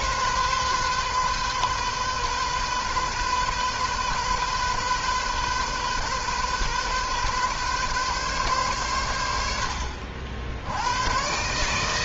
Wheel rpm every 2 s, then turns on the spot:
130, 130, 130, 130, 120, 80.
none